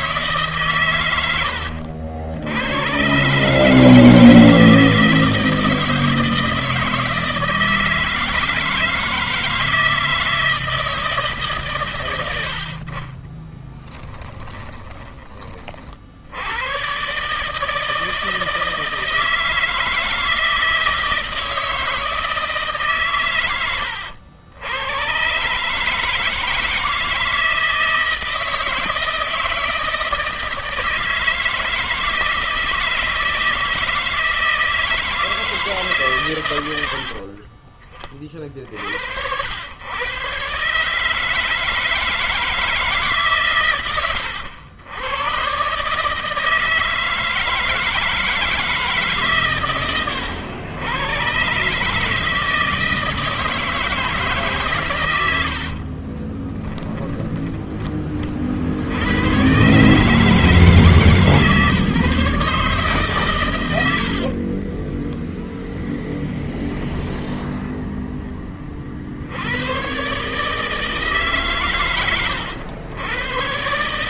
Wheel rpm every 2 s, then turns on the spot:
130, 120, 160, 160, 160, 160, 60, 10, 110, 160, 160, 130, 100, 160, 160, 160, 160, 160, 80, 50, 140, 150, 90, 160, 150, 110, 160, 120, 20, 70, 160, 140, 20, 10, 30, 150, 110.
36-38 56-58 64-68